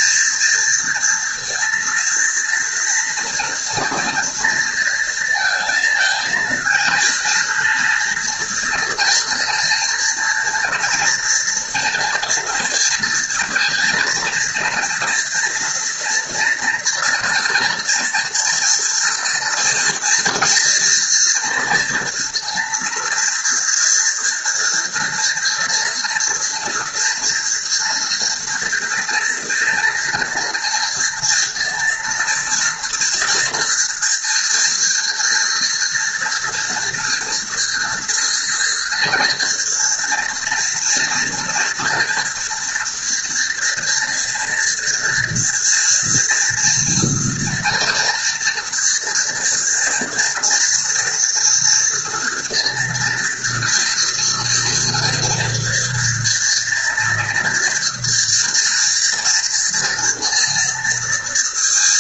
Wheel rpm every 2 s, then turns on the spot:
230, 230, 230, 230, 230, 230, 230, 230, 230, 240, 230, 230, 240, 230, 230, 230, 230, 230, 230, 240, 230, 230, 230, 230, 230, 230, 230, 230, 240, 230, 230.
none